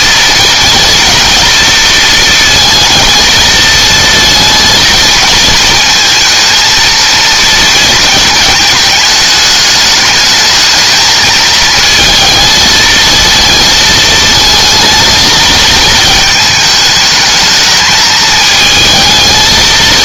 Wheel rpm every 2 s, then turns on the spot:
230, 230, 230, 230, 220, 220, 220, 220, 220, 220.
none